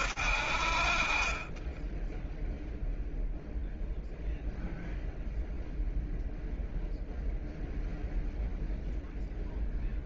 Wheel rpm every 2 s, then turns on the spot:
60, 10, 0, 0, 0.
none